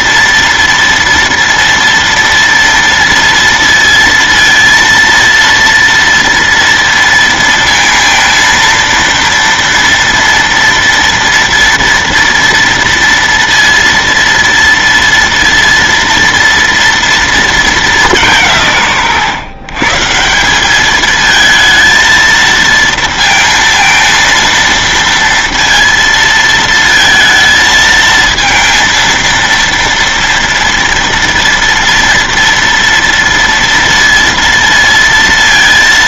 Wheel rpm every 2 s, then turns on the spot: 230, 230, 230, 230, 230, 230, 230, 230, 230, 150, 200, 230, 230, 220, 230, 230, 230, 230.
none